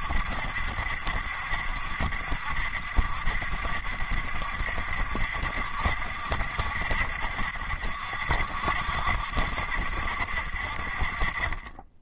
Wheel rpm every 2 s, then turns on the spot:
70, 70, 70, 70, 70, 50.
none